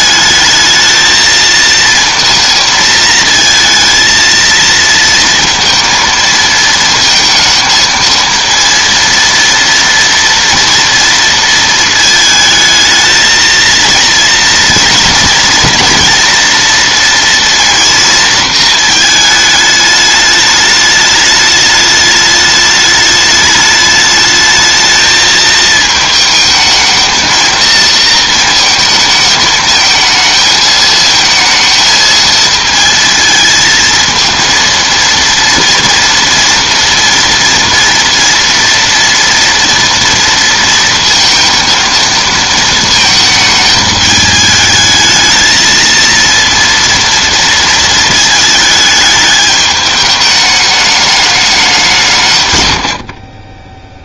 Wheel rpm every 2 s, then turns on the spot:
220, 230, 230, 230, 230, 230, 220, 230, 240, 220, 210, 210, 220, 220, 230, 220, 220, 230, 230, 230, 230, 230, 210, 230, 210, 210, 120.
none